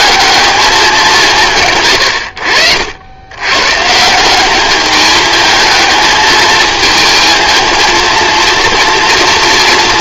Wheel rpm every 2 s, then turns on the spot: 210, 70, 200, 220, 230.
none